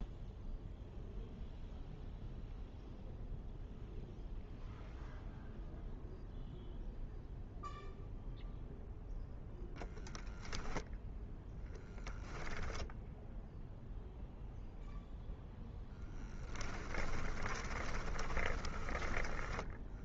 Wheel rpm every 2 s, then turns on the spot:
0, 0, 0, 0, 0, 0, 0, 0, 10, 20.
16-20